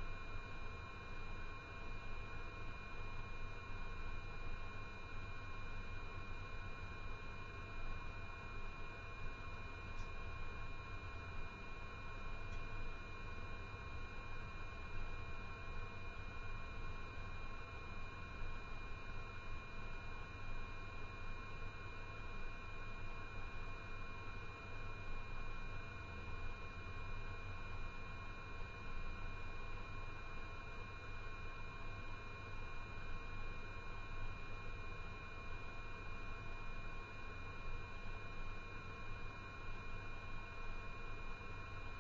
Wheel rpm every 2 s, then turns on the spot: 0, 0, 0, 0, 0, 0, 0, 0, 0, 0, 0, 0, 0, 0, 0, 0, 0, 0, 0, 0, 0.
none